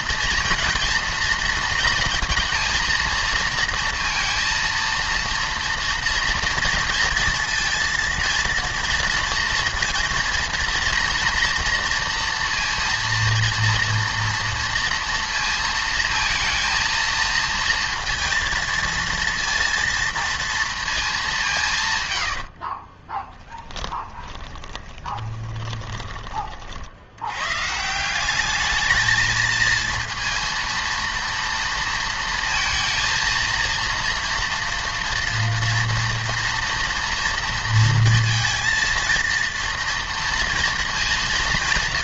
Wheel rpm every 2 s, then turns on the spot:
230, 230, 230, 230, 230, 230, 230, 230, 220, 230, 230, 50, 20, 50, 210, 230, 230, 230, 230, 230, 230.
22-26